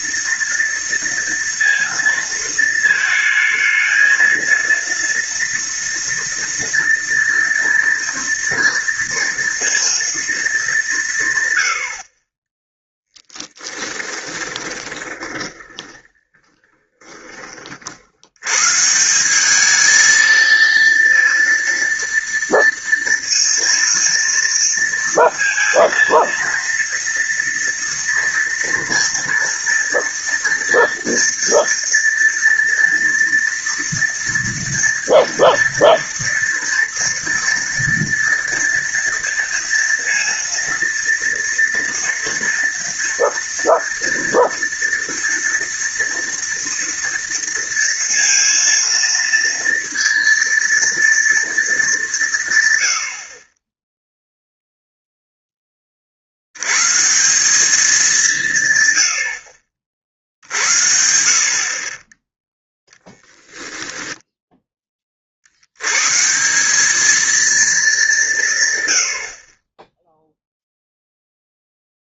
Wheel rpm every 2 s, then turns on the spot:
230, 220, 230, 240, 230, 200, 20, 20, 30, 130, 230, 230, 230, 230, 230, 230, 230, 230, 230, 230, 230, 230, 230, 230, 230, 230, 140, 0, 100, 130, 70, 10, 10, 180, 130, 0.
14-18